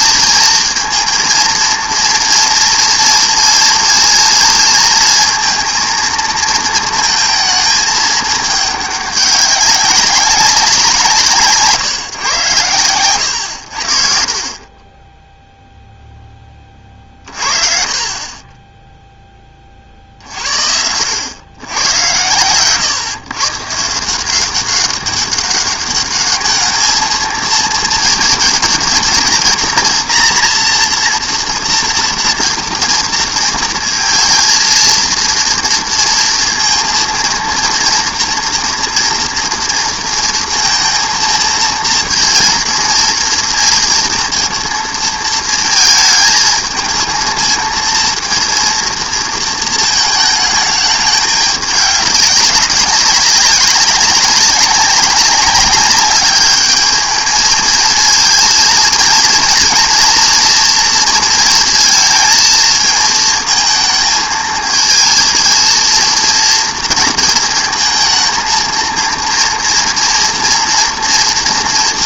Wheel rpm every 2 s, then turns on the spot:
220, 230, 230, 230, 210, 180, 110, 30, 30, 20, 80, 120, 190, 210, 220, 230, 230, 230, 230, 230, 230, 230, 230, 220, 230, 210, 200, 190, 210, 230, 230, 220, 220, 230, 230, 240.
none